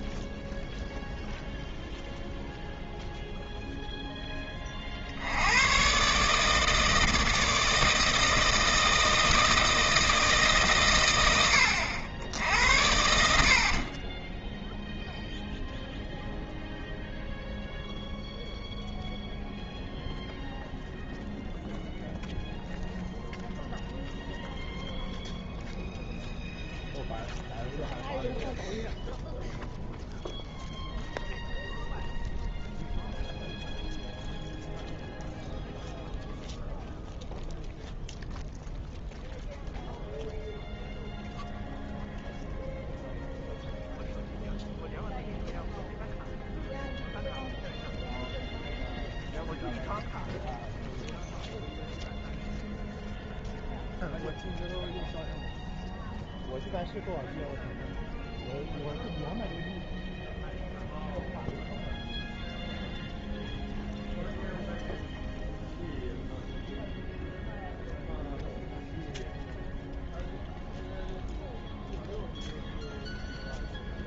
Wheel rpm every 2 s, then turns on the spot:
0, 0, 50, 160, 160, 130, 80, 0, 0, 0, 0, 0, 0, 0, 0, 0, 0, 0, 0, 0, 0, 0, 0, 0, 0, 0, 0, 0, 0, 0, 0, 0, 0, 0, 0, 0, 0.
12-14